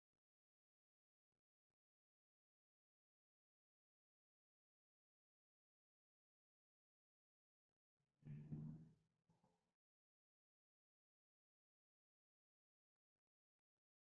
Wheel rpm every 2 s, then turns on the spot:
0, 0, 0, 0, 0, 0, 0.
none